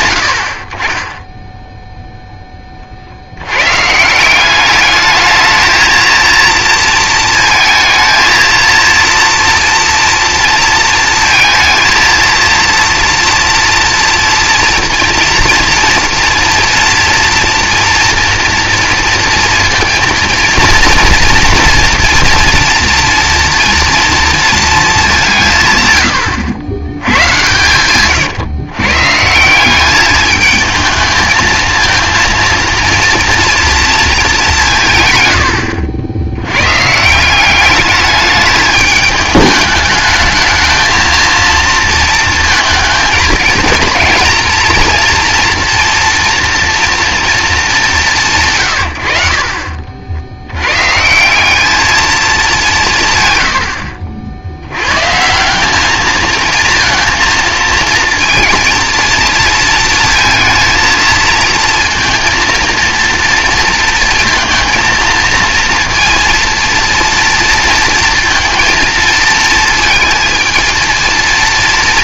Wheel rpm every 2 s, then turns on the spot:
70, 20, 200, 230, 230, 230, 230, 230, 230, 230, 230, 230, 230, 100, 130, 220, 230, 180, 100, 210, 220, 230, 230, 230, 140, 110, 190, 90, 230, 230, 230, 230, 230, 230, 230, 220.
none